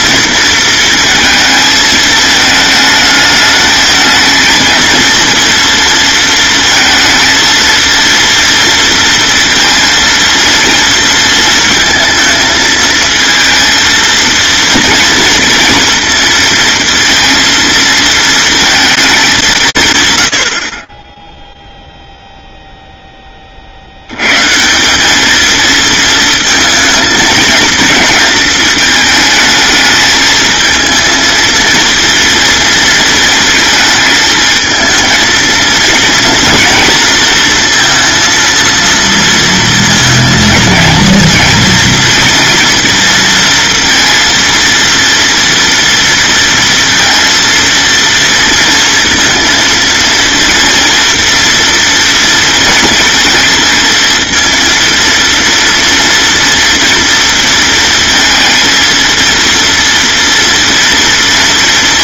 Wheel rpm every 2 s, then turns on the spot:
230, 220, 230, 230, 230, 230, 220, 230, 230, 230, 30, 0, 170, 220, 220, 220, 230, 220, 230, 230, 230, 230, 230, 230, 230, 230, 230, 230, 240, 230, 230.
none